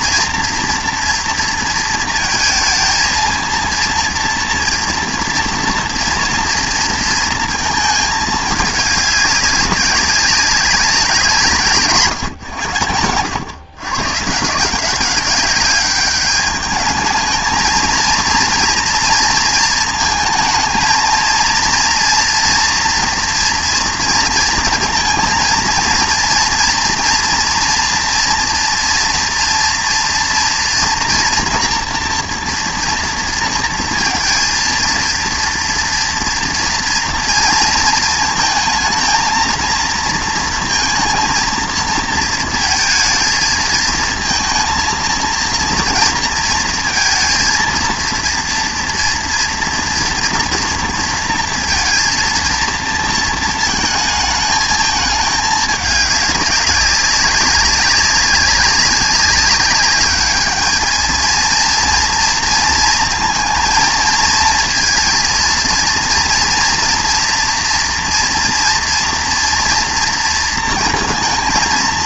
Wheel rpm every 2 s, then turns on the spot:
230, 220, 230, 230, 210, 190, 110, 160, 210, 230, 230, 230, 240, 230, 230, 230, 230, 230, 230, 220, 230, 220, 230, 230, 230, 230, 230, 220, 200, 200, 210, 230, 230, 230, 240, 230.
none